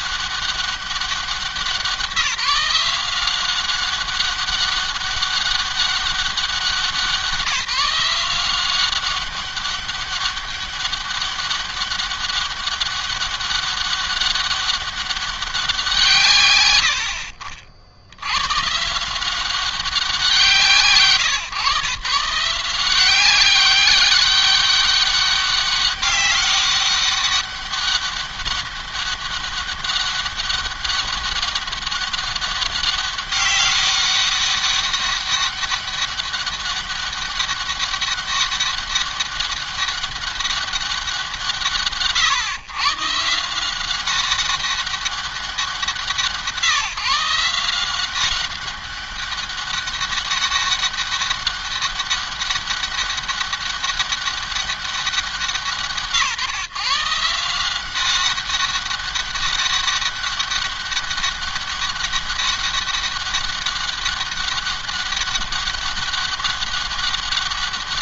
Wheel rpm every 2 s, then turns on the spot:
200, 180, 200, 190, 180, 200, 200, 200, 110, 120, 170, 170, 200, 200, 200, 200, 200, 200, 200, 200, 200, 130, 200, 170, 190, 200, 200, 190, 130, 200, 200, 200, 200, 200.
none